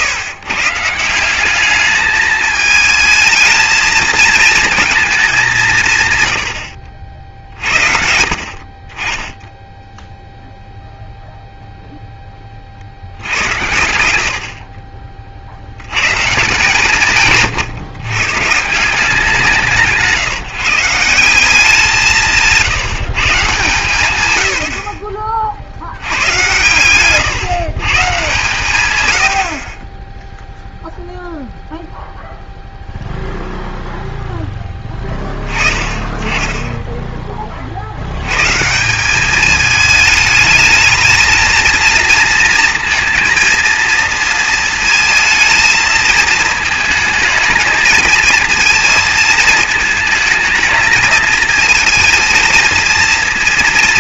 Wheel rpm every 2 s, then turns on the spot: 150, 220, 220, 80, 40, 0, 60, 40, 170, 150, 150, 170, 60, 120, 120, 0, 0, 10, 10, 170, 220, 230, 230, 220, 230, 220, 220.
none